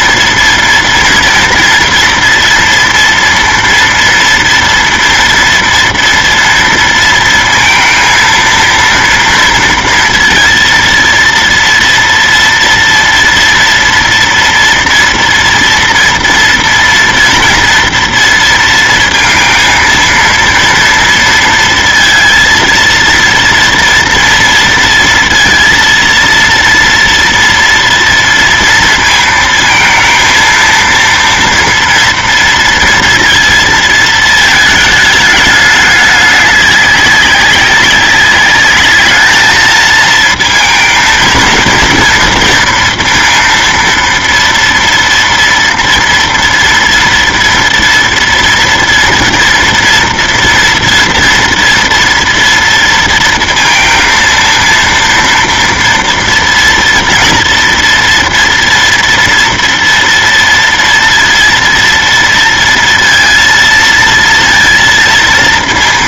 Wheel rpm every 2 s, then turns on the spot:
230, 230, 230, 230, 230, 230, 240, 230, 230, 230, 230, 230, 230, 230, 230, 230, 230, 220, 200, 210, 230, 230, 230, 230, 230, 230, 230, 230, 240, 230, 230, 230, 230.
none